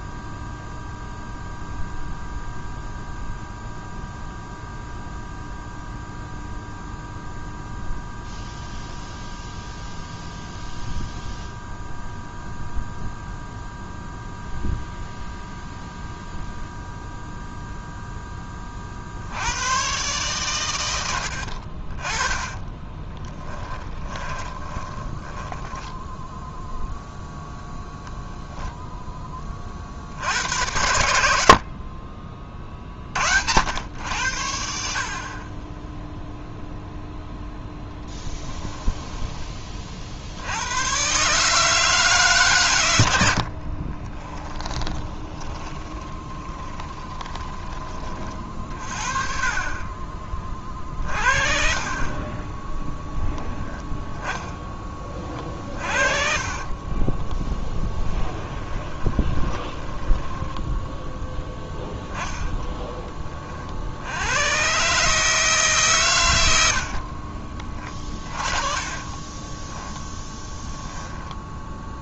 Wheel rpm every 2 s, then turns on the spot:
0, 0, 0, 0, 0, 0, 0, 0, 0, 50, 100, 20, 10, 0, 0, 80, 50, 50, 0, 10, 110, 110, 20, 20, 50, 40, 10, 30, 20, 20, 10, 10, 140, 70, 30, 10.
22-26 38-40 44-48 56-60 66-70